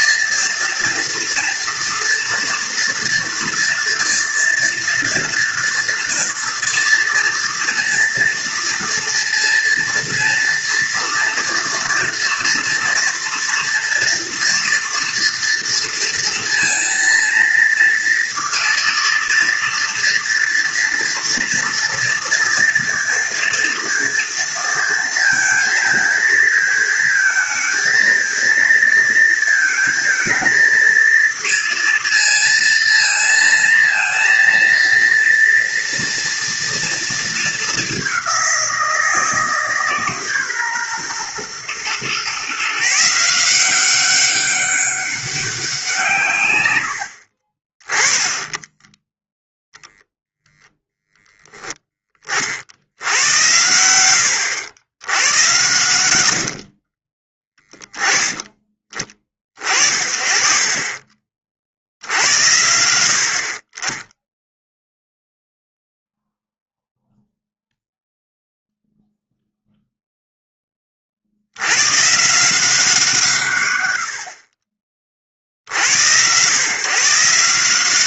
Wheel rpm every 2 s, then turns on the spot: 230, 230, 240, 230, 230, 230, 230, 230, 230, 230, 230, 230, 230, 220, 230, 220, 230, 230, 230, 180, 140, 140, 200, 90, 10, 0, 60, 80, 50, 20, 30, 70, 0, 0, 0, 20, 180, 50, 130.
56-58